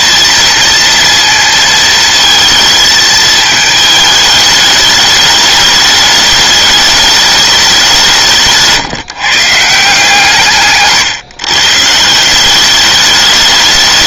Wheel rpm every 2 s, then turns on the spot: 230, 220, 210, 210, 160, 140, 200.
none